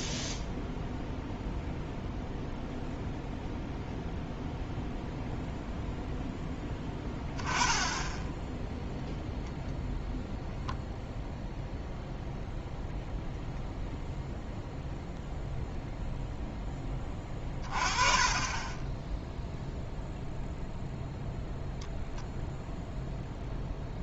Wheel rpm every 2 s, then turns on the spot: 0, 0, 0, 10, 0, 10, 0, 0, 10, 20, 0, 0.
none